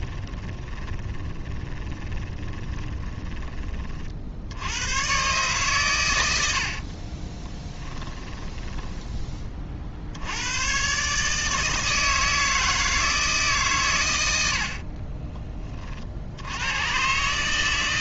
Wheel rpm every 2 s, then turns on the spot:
20, 20, 100, 50, 10, 120, 160, 50, 110.
0-4 6-10 14-16